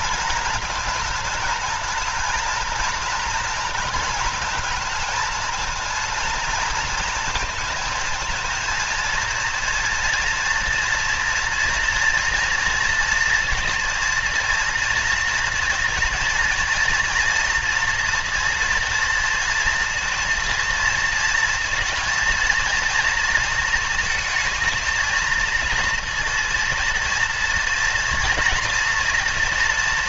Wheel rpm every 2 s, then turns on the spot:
230, 230, 220, 230, 230, 230, 230, 230, 230, 230, 230, 230, 220, 230, 230.
none